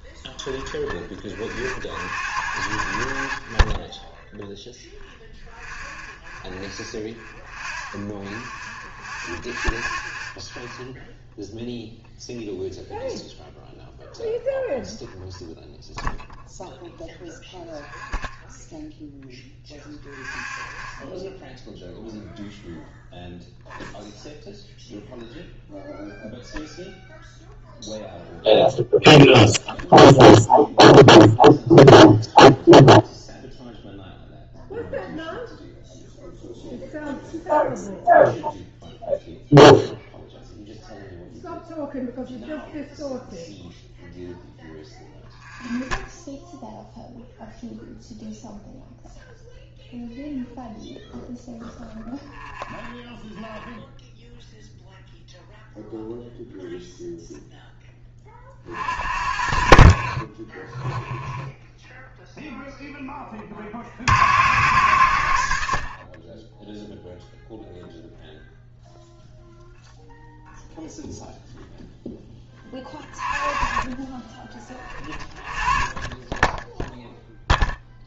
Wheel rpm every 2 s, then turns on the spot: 10, 60, 0, 0, 0, 0, 0, 0, 0, 0, 0, 0, 0, 0, 0, 0, 0, 0, 0, 0, 0, 0, 0, 0, 0, 0, 0, 0, 0, 50, 10, 0, 70, 10, 0, 0, 20, 30, 10.
0-2